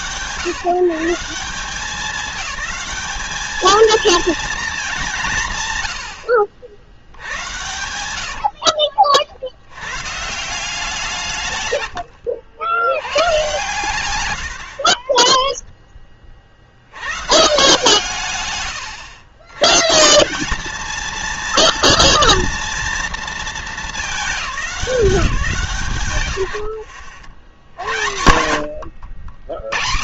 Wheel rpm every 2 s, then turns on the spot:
150, 210, 220, 80, 70, 170, 110, 60, 50, 130, 210, 230, 170, 110, 80.
8-10